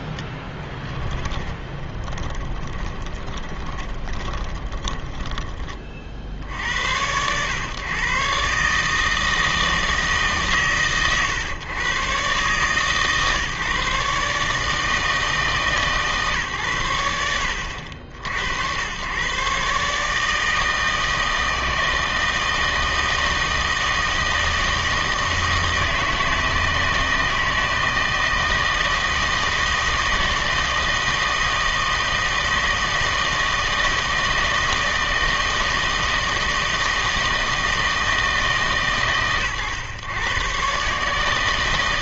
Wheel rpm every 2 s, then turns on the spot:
10, 30, 20, 80, 140, 140, 130, 150, 110, 90, 160, 160, 160, 160, 160, 170, 160, 160, 160, 140, 130.
0-6